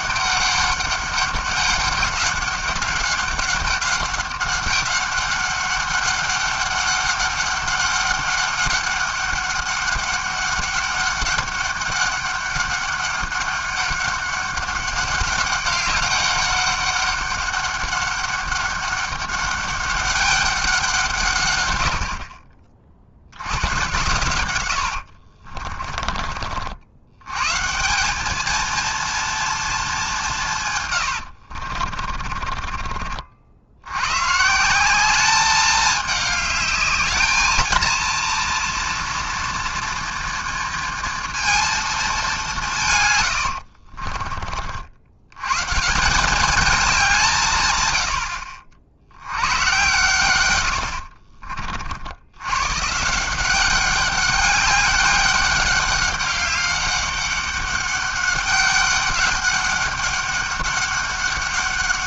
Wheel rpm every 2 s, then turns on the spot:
200, 200, 200, 200, 200, 200, 200, 200, 200, 200, 140, 70, 50, 120, 230, 90, 60, 210, 220, 230, 230, 90, 110, 170, 90, 40, 170, 200, 200, 190, 200.
24-26 30-32 42-44 50-52